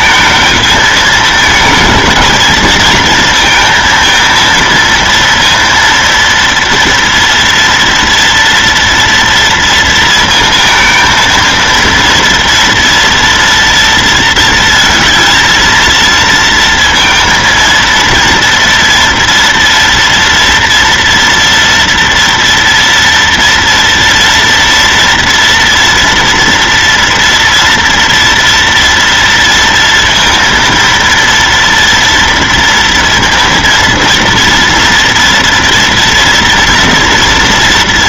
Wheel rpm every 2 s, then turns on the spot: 220, 220, 230, 230, 230, 230, 230, 230, 230, 230, 230, 230, 230, 230, 230, 230, 230, 230, 230.
none